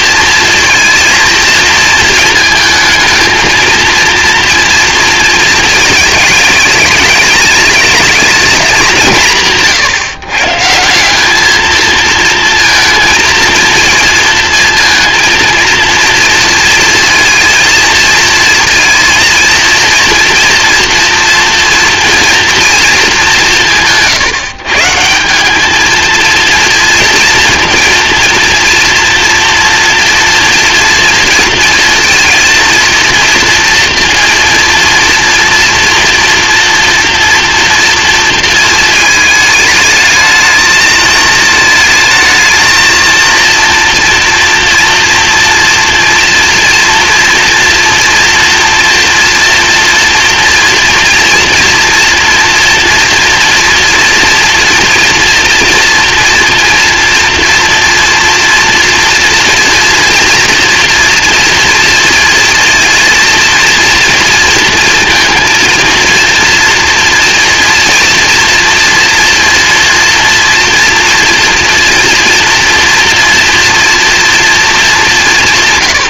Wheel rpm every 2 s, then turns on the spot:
230, 220, 230, 210, 200, 140, 230, 230, 230, 230, 230, 230, 150, 230, 230, 230, 230, 230, 230, 230, 220, 220, 230, 230, 230, 240, 230, 230, 230, 230, 240, 230, 230, 230, 230, 230, 230, 220.
none